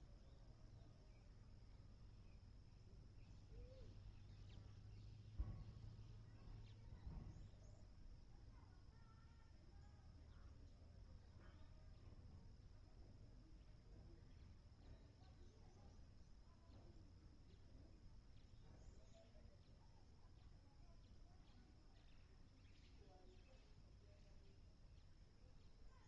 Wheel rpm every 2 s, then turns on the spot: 0, 0, 0, 0, 0, 0, 0, 0, 0, 0, 0, 0, 0.
none